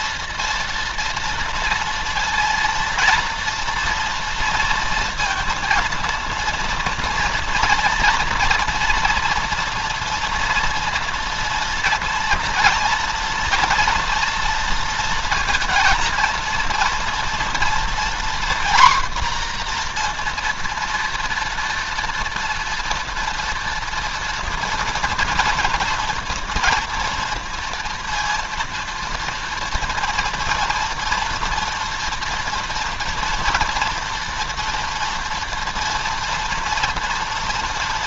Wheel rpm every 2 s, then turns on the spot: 230, 230, 230, 230, 230, 230, 230, 230, 230, 240, 230, 230, 230, 230, 230, 230, 230, 230, 230.
none